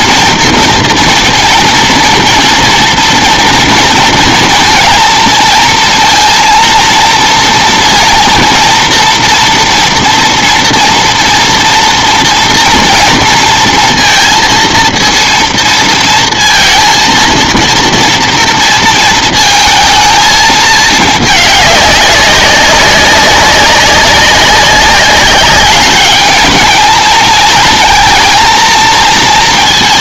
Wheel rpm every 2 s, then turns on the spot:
230, 230, 230, 230, 230, 230, 230, 230, 230, 230, 220, 190, 190, 220, 230.
none